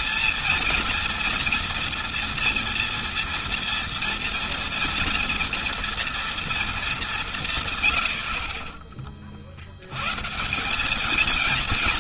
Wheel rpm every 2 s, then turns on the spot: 230, 230, 230, 230, 40, 150.
none